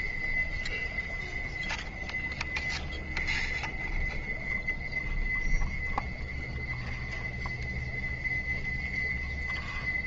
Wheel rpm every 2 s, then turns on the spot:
0, 0, 0, 0, 0.
none